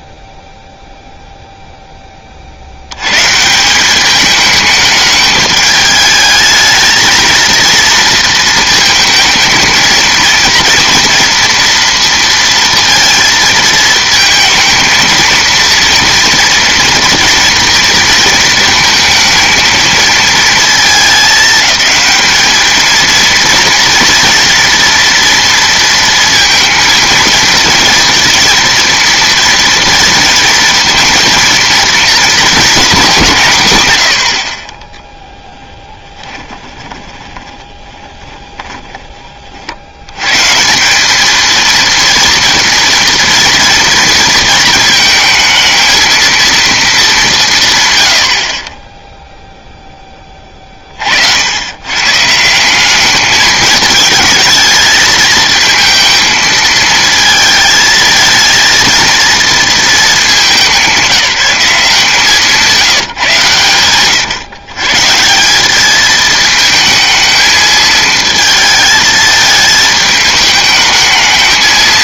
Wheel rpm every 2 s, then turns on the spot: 0, 10, 200, 210, 230, 230, 230, 220, 230, 230, 230, 210, 240, 230, 230, 240, 230, 110, 20, 10, 110, 230, 230, 230, 50, 30, 170, 220, 220, 230, 200, 160, 130, 220, 220, 210.
34-40